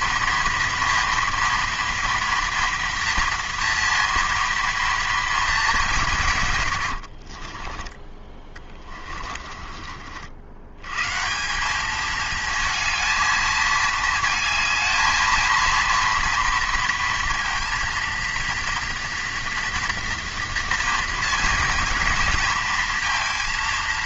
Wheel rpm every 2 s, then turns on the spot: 230, 230, 230, 120, 20, 110, 220, 220, 240, 230, 230, 230.
6-10